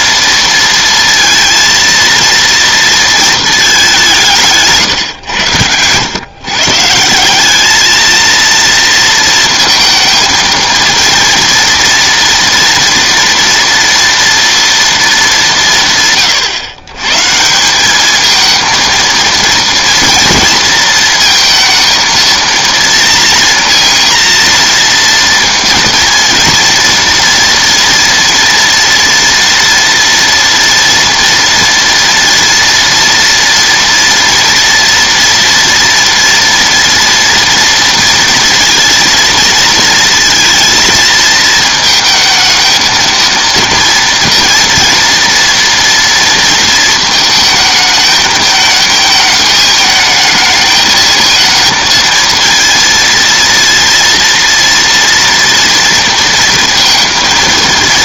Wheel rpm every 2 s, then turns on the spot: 230, 230, 130, 160, 230, 230, 230, 230, 120, 230, 230, 230, 230, 230, 230, 230, 230, 230, 230, 230, 220, 230, 230, 220, 220, 220, 230, 230, 230.
none